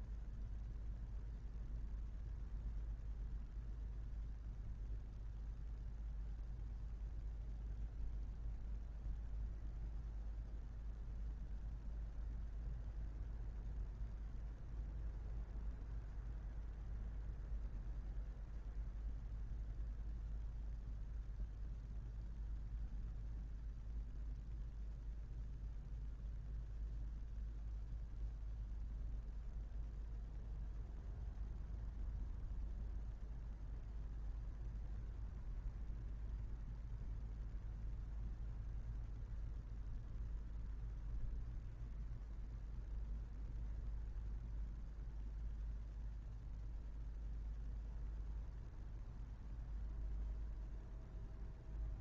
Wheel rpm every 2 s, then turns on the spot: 0, 0, 0, 0, 0, 0, 0, 0, 0, 0, 0, 0, 0, 0, 0, 0, 0, 0, 0, 0, 0, 0, 0, 0, 0, 0.
none